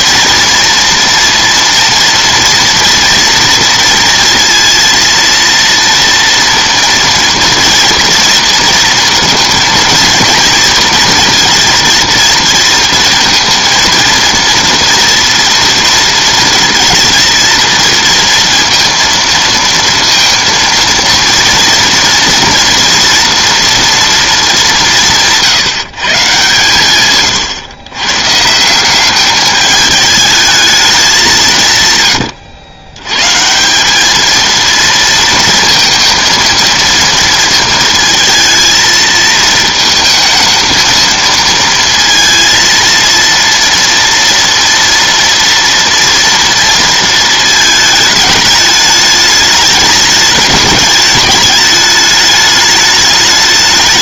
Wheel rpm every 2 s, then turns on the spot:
230, 230, 230, 230, 230, 230, 230, 230, 230, 230, 230, 230, 170, 130, 190, 200, 110, 230, 230, 220, 220, 230, 230, 230, 210, 210, 210.
none